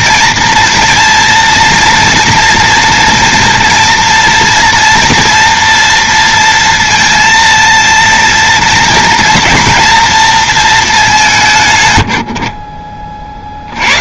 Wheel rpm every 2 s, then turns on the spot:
230, 230, 230, 230, 240, 230, 50.
none